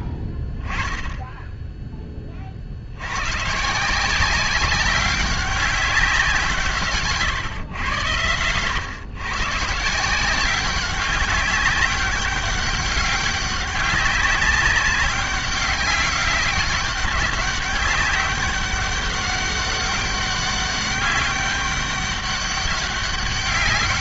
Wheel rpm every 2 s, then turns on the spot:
10, 40, 190, 160, 110, 190, 200, 190, 200, 200, 200, 200.
none